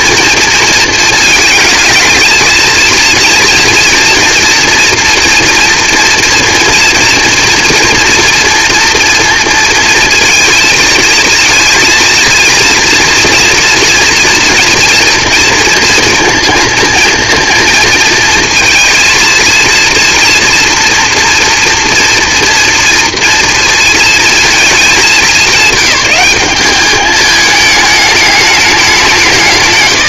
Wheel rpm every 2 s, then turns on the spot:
230, 230, 230, 230, 240, 230, 230, 240, 230, 230, 230, 230, 220, 200, 200.
none